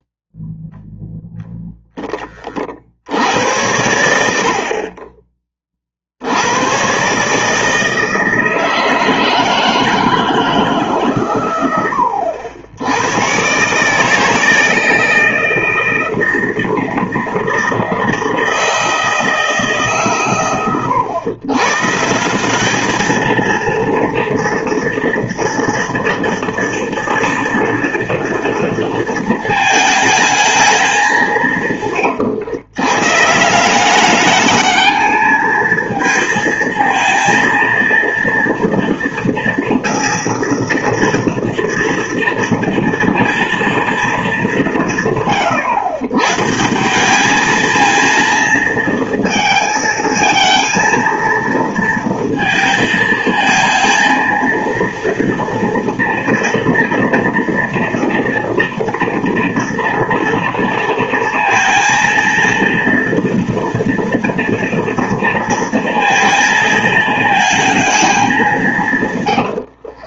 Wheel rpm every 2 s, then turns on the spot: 0, 70, 30, 130, 160, 140, 100, 160, 160, 160, 100, 210, 230, 230, 230, 190, 140, 220, 230, 230, 230, 230, 150, 200, 230, 230, 220, 230, 230, 230, 230, 230, 230, 220, 130.
68-70